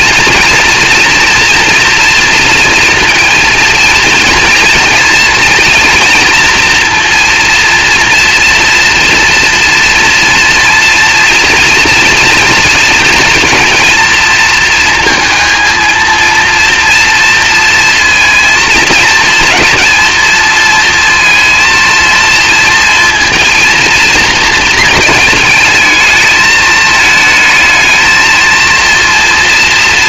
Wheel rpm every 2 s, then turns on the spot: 230, 230, 230, 230, 230, 230, 230, 230, 230, 220, 230, 230, 220, 220, 230.
none